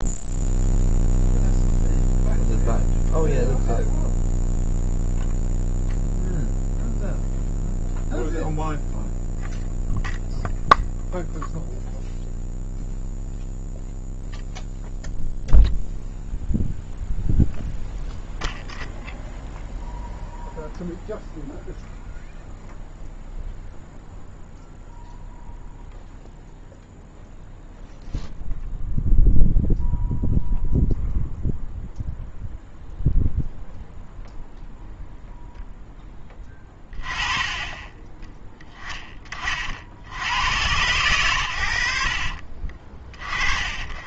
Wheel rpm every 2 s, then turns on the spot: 0, 0, 0, 0, 0, 0, 0, 0, 0, 0, 0, 0, 0, 0, 0, 0, 0, 0, 20, 20, 110, 40.
36-38